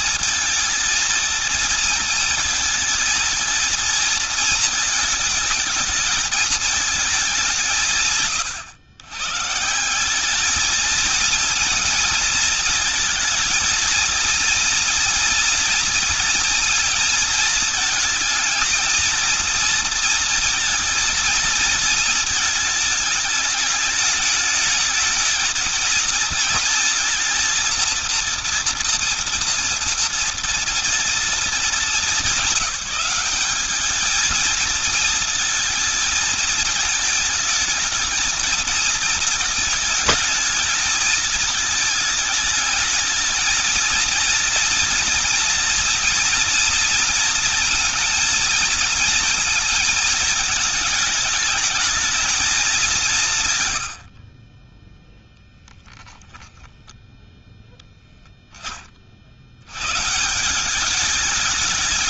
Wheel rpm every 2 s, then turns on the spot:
230, 230, 220, 190, 120, 230, 230, 230, 230, 230, 230, 220, 220, 230, 230, 240, 200, 230, 220, 220, 220, 210, 230, 230, 230, 220, 180, 10, 10, 20, 190.
none